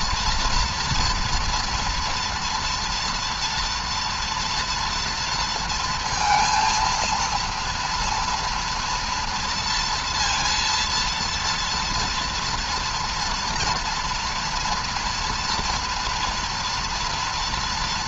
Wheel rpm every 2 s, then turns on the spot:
230, 230, 240, 230, 230, 230, 230, 230, 230.
none